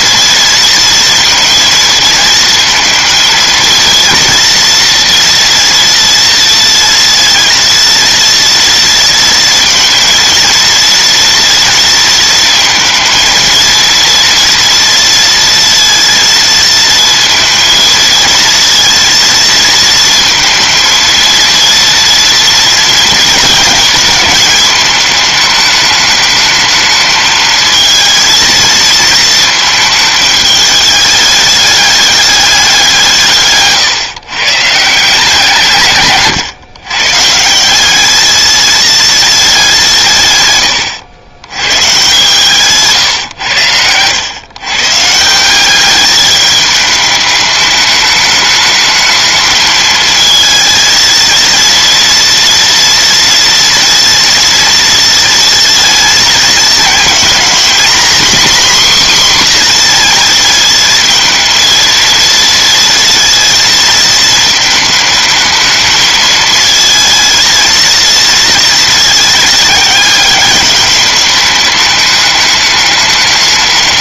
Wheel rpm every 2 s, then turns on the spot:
230, 230, 230, 230, 230, 230, 230, 230, 230, 230, 230, 230, 210, 220, 230, 210, 190, 150, 120, 220, 110, 150, 130, 210, 210, 230, 230, 230, 220, 260, 220, 230, 220, 220, 230, 200, 210.
none